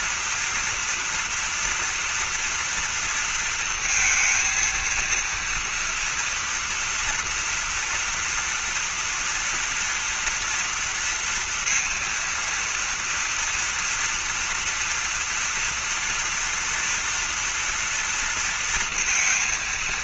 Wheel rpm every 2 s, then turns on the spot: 230, 240, 230, 230, 230, 230, 230, 230, 240, 230.
none